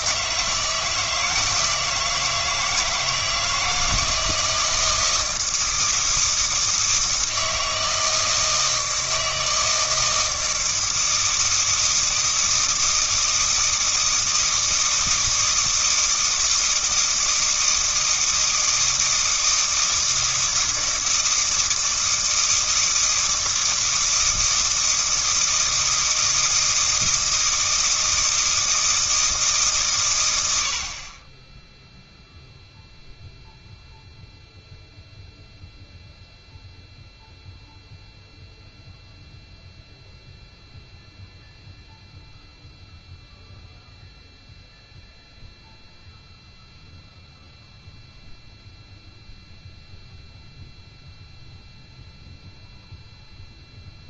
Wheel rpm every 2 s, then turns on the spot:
160, 160, 160, 160, 160, 160, 160, 160, 160, 160, 160, 160, 160, 160, 160, 70, 0, 0, 0, 0, 0, 0, 0, 0, 0, 0, 0.
none